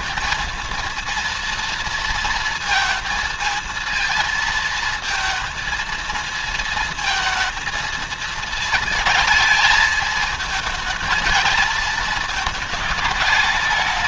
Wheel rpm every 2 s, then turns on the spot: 230, 220, 220, 220, 220, 220, 220.
none